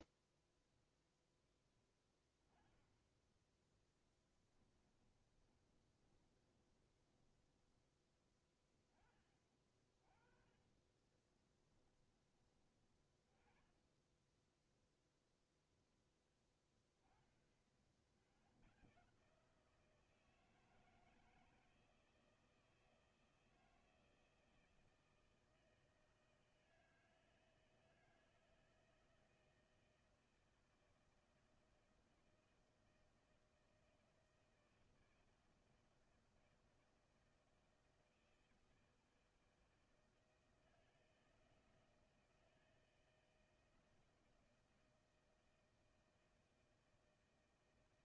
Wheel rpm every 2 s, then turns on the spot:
0, 10, 10, 20, 20, 30, 20, 10, 10, 80, 160, 160, 160, 160, 160, 160, 160, 160, 160, 160, 160, 160, 160, 160.
4-8 10-12